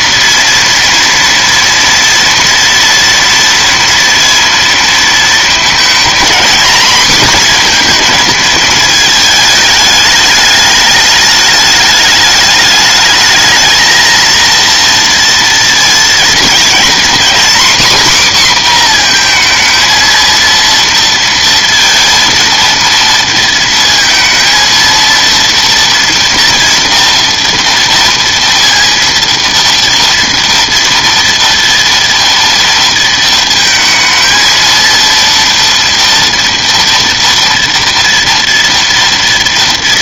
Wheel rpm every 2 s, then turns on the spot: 240, 230, 230, 230, 230, 210, 210, 230, 230, 250, 230, 230, 230, 240, 230, 230, 230, 230, 230, 230.
none